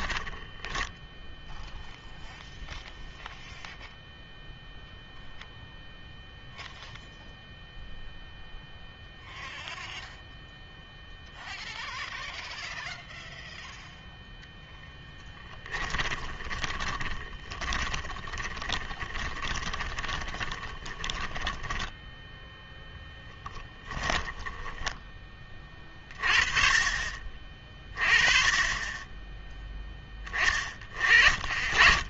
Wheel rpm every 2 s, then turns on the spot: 10, 0, 0, 0, 0, 0, 0, 0, 20, 20, 20, 0, 10, 40, 30, 30.
16-22 24-26